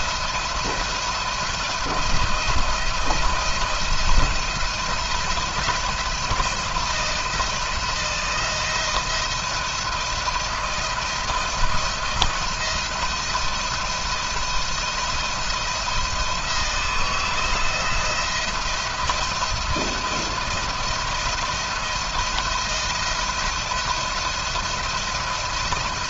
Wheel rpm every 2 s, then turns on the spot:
170, 170, 170, 170, 170, 170, 170, 170, 160, 170, 170, 170, 170.
none